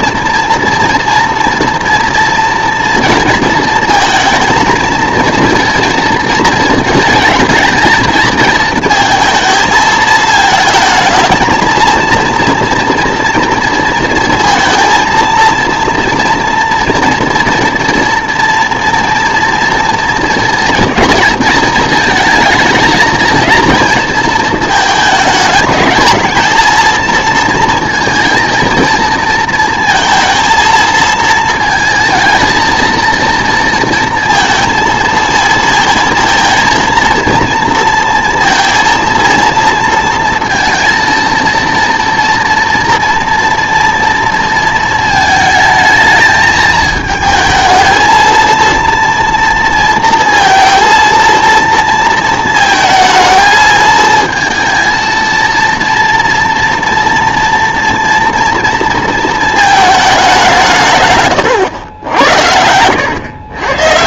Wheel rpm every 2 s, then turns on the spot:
230, 230, 220, 220, 220, 220, 230, 230, 240, 230, 220, 220, 220, 230, 230, 220, 230, 230, 230, 230, 230, 230, 220, 220, 230, 230, 230, 230, 230, 230, 140, 110.
none